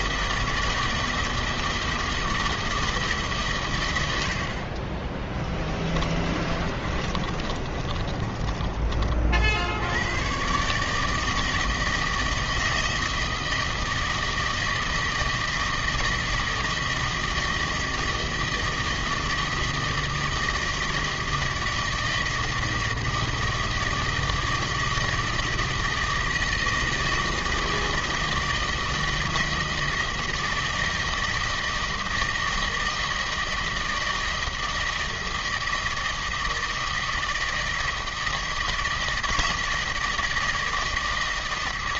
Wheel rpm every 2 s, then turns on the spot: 160, 150, 20, 30, 40, 150, 160, 160, 160, 160, 160, 160, 160, 160, 160, 160, 160, 160, 160, 160, 160.
4-8